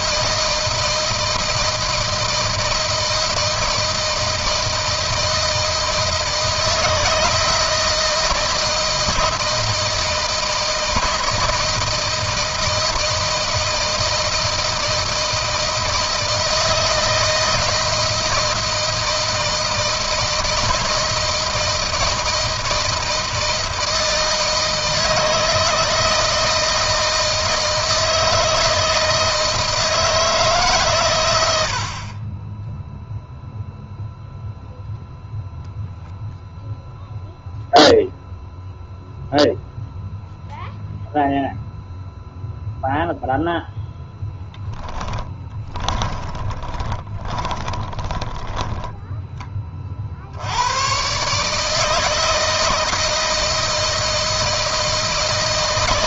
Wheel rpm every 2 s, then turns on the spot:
160, 160, 160, 160, 160, 160, 160, 160, 160, 160, 160, 160, 160, 160, 160, 120, 0, 0, 0, 0, 0, 0, 20, 20, 10, 120, 160, 160.
44-48